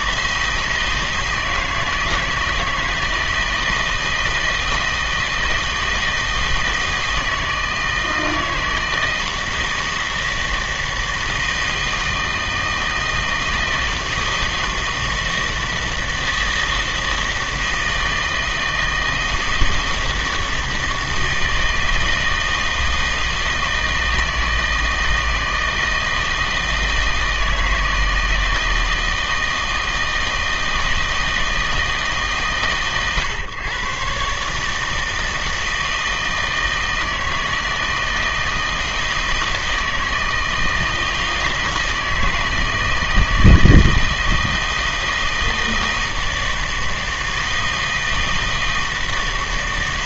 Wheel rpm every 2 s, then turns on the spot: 160, 160, 160, 160, 160, 160, 160, 160, 160, 160, 160, 160, 160, 160, 160, 160, 130, 150, 160, 160, 160, 160, 160, 160, 160.
none